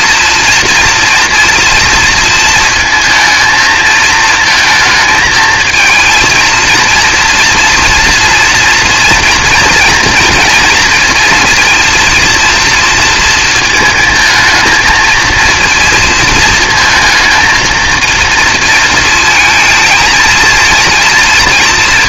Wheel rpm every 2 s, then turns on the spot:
240, 230, 220, 230, 230, 230, 230, 220, 220, 230, 220.
none